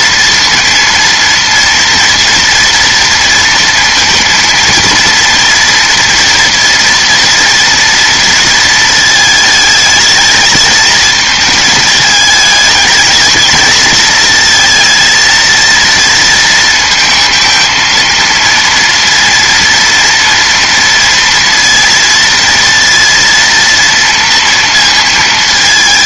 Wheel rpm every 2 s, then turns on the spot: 230, 230, 230, 230, 220, 220, 220, 230, 220, 230, 230, 230, 220.
none